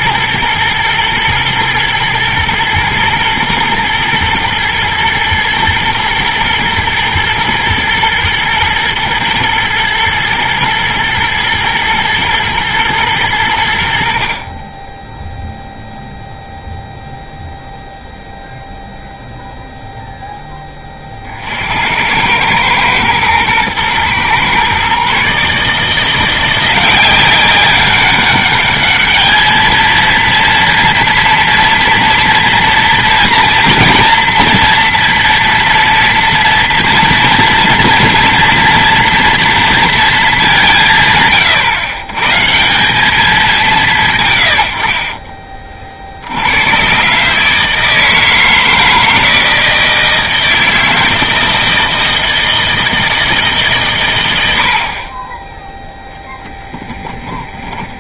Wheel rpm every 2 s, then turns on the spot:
110, 120, 110, 120, 120, 110, 110, 20, 0, 0, 20, 110, 130, 180, 210, 230, 230, 230, 230, 240, 160, 180, 80, 110, 160, 160, 160, 70, 10.
none